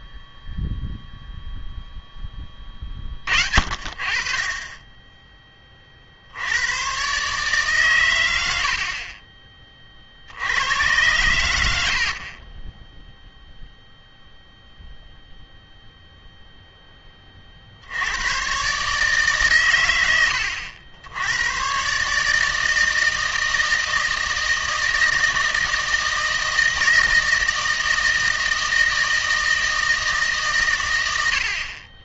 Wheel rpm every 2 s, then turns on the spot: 0, 30, 20, 110, 60, 110, 10, 0, 10, 140, 80, 160, 160, 160, 160, 120.
none